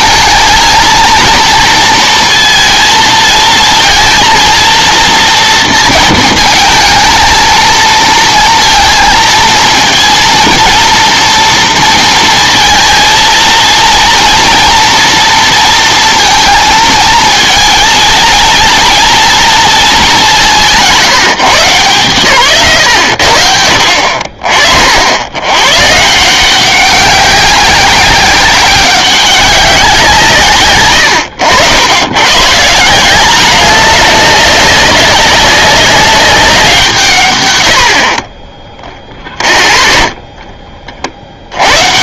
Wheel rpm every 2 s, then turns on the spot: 220, 230, 230, 220, 230, 230, 230, 230, 220, 230, 180, 110, 50, 190, 190, 110, 160, 200, 180, 0, 30.
none